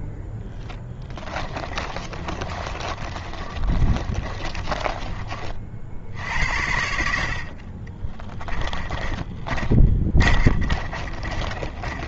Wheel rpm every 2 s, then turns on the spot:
10, 30, 30, 80, 20, 40.
0-6 8-12